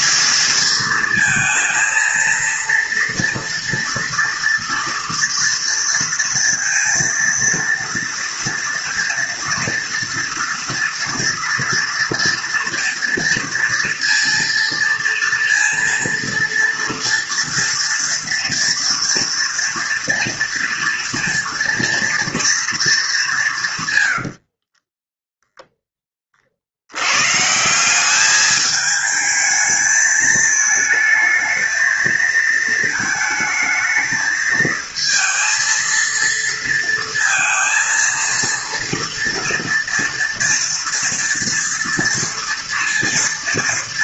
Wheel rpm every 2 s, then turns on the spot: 220, 230, 240, 230, 230, 230, 230, 230, 230, 240, 230, 220, 30, 80, 210, 220, 230, 220, 230, 230, 240, 230.
24-26